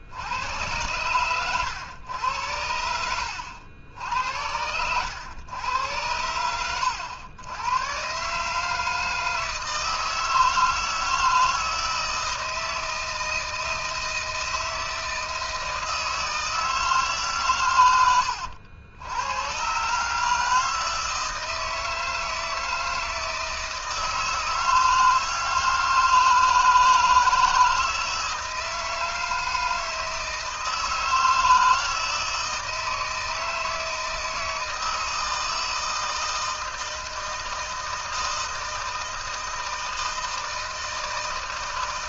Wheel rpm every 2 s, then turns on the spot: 110, 100, 100, 100, 160, 160, 160, 160, 160, 80, 160, 160, 160, 160, 160, 160, 160, 160, 160, 160, 160.
none